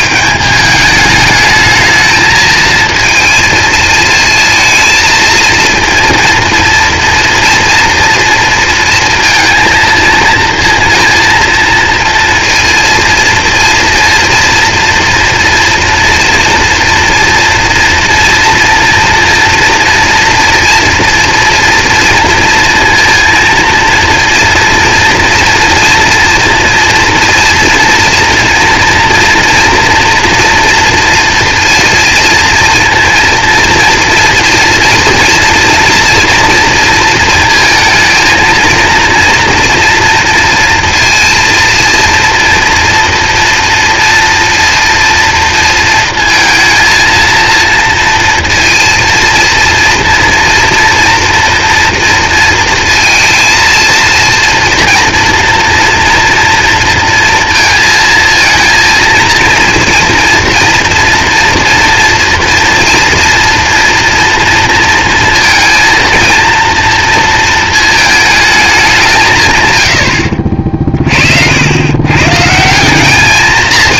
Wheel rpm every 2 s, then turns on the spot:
210, 220, 220, 230, 230, 230, 230, 240, 240, 230, 230, 230, 230, 230, 230, 230, 230, 230, 230, 230, 230, 240, 230, 230, 230, 230, 230, 230, 230, 230, 230, 240, 230, 230, 190, 50, 180.
70-72